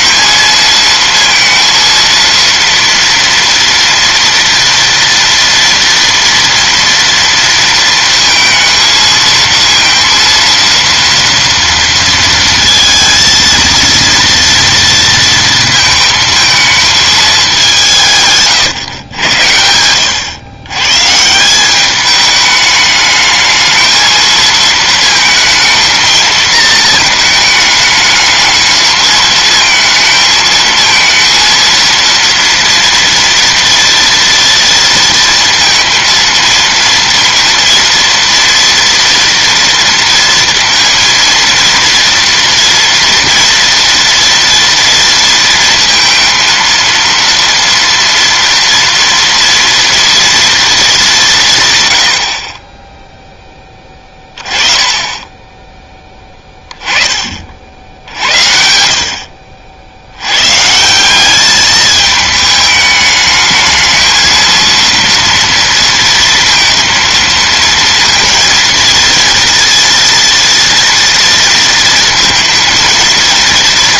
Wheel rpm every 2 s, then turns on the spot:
230, 230, 230, 230, 220, 230, 220, 230, 220, 120, 130, 210, 220, 220, 220, 220, 230, 230, 230, 240, 230, 230, 230, 230, 230, 220, 20, 20, 20, 70, 150, 210, 230, 230, 230, 230, 220.
none